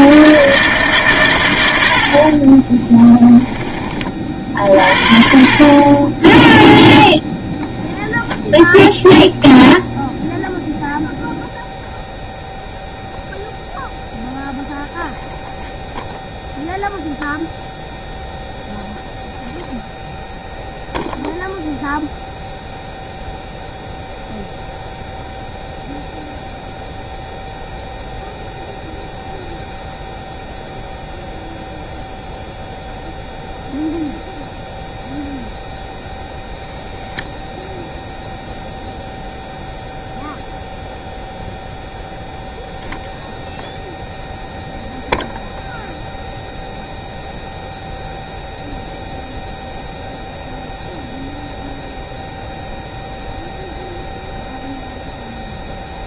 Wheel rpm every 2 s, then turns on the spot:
140, 10, 50, 0, 0, 0, 0, 0, 0, 0, 0, 0, 0, 0, 0, 0, 0, 0, 0, 0, 0, 0, 0, 0, 0, 0, 0, 0.
2-4